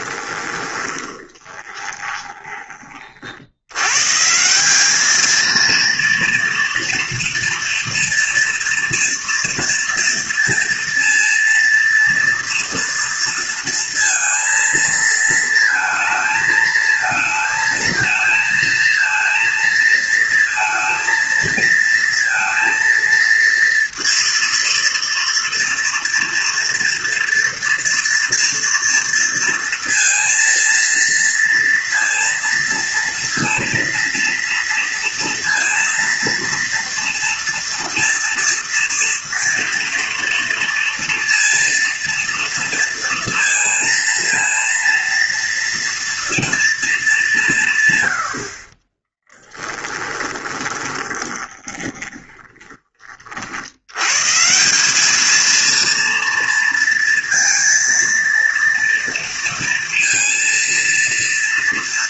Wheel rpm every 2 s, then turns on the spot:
20, 40, 210, 230, 230, 230, 230, 230, 220, 230, 230, 230, 230, 230, 230, 230, 230, 230, 230, 230, 230, 230, 240, 220, 30, 20, 30, 210, 230, 230, 230.
0-2 48-52